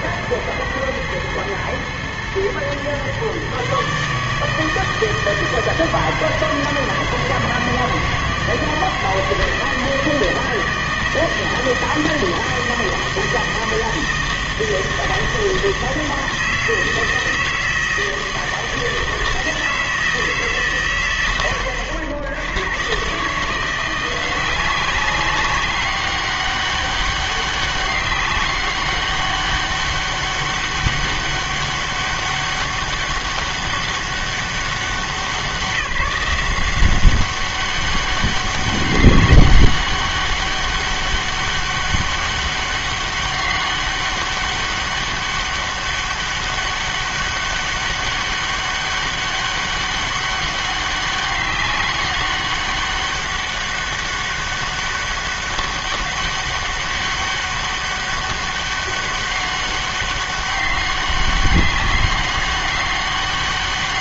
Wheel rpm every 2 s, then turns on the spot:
110, 120, 160, 160, 160, 160, 160, 160, 160, 160, 140, 100, 180, 200, 200, 200, 200, 190, 170, 200, 200, 200, 200, 200, 200, 200, 200, 200, 200, 200, 200, 200.
none